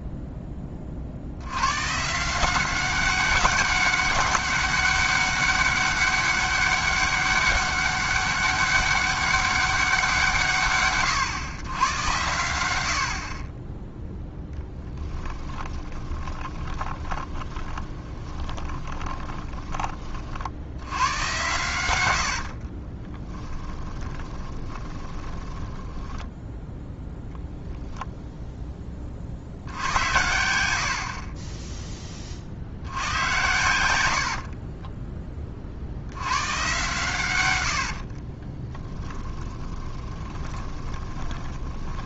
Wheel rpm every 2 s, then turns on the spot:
30, 190, 200, 200, 200, 90, 80, 10, 10, 10, 70, 40, 20, 10, 10, 80, 50, 40, 110, 30, 20.
14-20 22-26 34-36 38-42